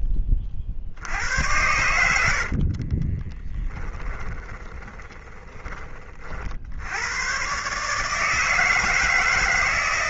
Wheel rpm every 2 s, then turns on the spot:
40, 50, 20, 60, 160.
2-6